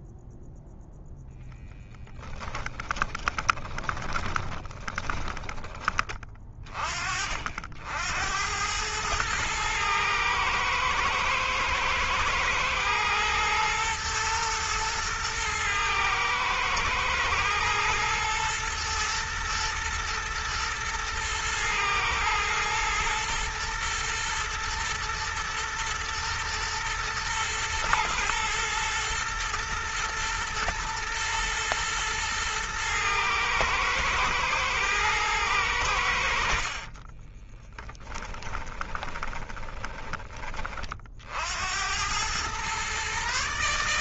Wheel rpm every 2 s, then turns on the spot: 0, 20, 10, 20, 90, 110, 110, 120, 110, 120, 120, 110, 110, 110, 120, 110, 110, 110, 60, 20, 30, 110.
2-6 36-40